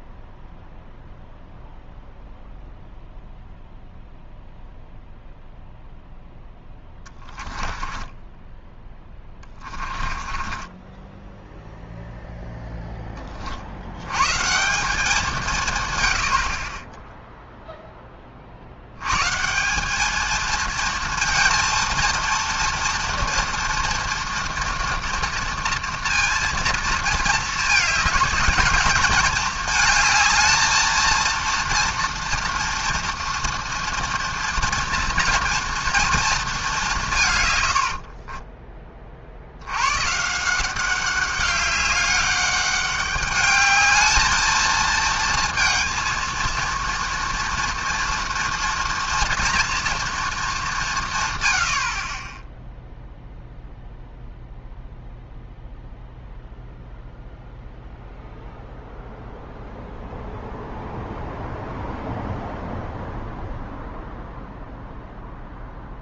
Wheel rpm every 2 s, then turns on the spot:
0, 0, 0, 10, 10, 20, 0, 170, 50, 60, 220, 230, 240, 230, 220, 220, 240, 230, 210, 30, 170, 200, 220, 230, 230, 200, 0, 0, 0, 0, 0, 0, 0.
6-8 10-12